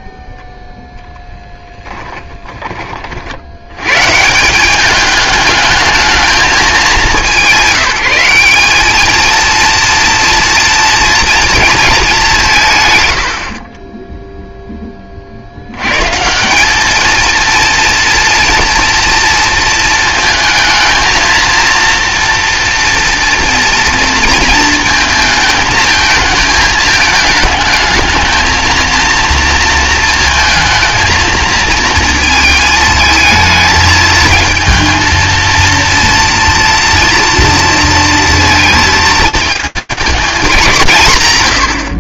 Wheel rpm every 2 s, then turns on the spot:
0, 20, 190, 200, 200, 230, 130, 10, 200, 230, 220, 230, 220, 220, 220, 230, 230, 230, 230, 220, 190.
none